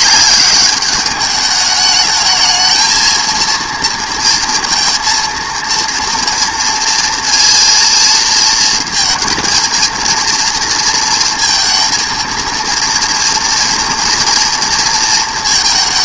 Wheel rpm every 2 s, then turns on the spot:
200, 220, 230, 230, 230, 230, 230, 230.
none